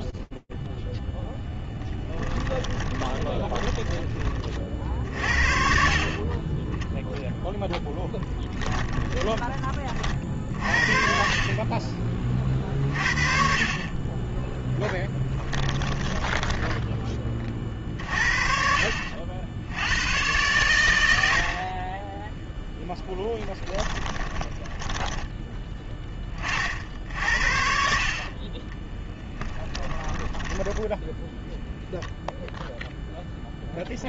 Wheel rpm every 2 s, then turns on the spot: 0, 10, 50, 0, 20, 30, 50, 10, 30, 70, 70, 20, 10, 60, 10, 0, 0.
2-4 8-10 14-16 22-24 28-30